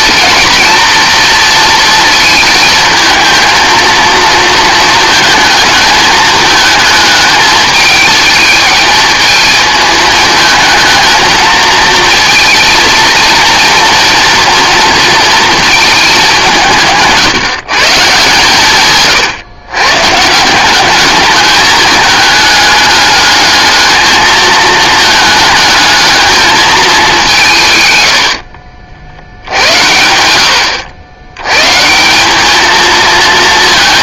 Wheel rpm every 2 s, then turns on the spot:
230, 220, 230, 220, 220, 220, 230, 230, 180, 140, 180, 210, 220, 220, 60, 80, 210.
none